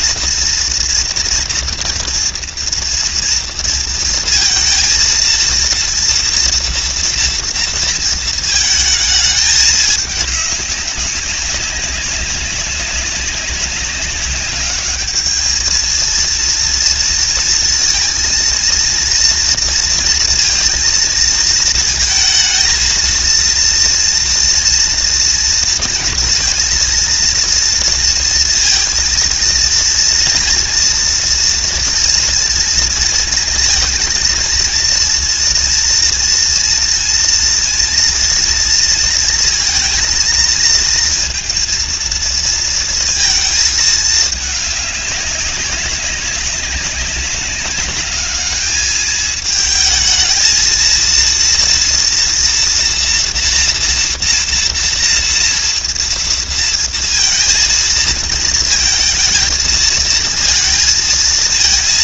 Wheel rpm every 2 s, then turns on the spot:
240, 240, 230, 230, 220, 200, 190, 210, 230, 230, 230, 230, 230, 230, 230, 230, 230, 230, 230, 230, 230, 230, 200, 190, 220, 230, 240, 230, 230, 230, 230.
none